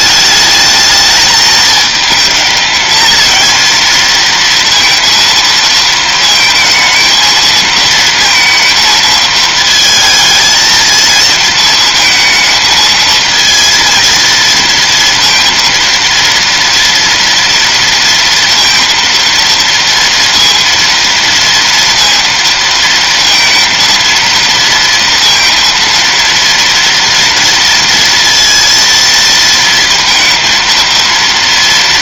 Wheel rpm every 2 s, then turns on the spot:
210, 220, 230, 220, 230, 230, 220, 230, 230, 230, 230, 230, 230, 230, 230, 230.
none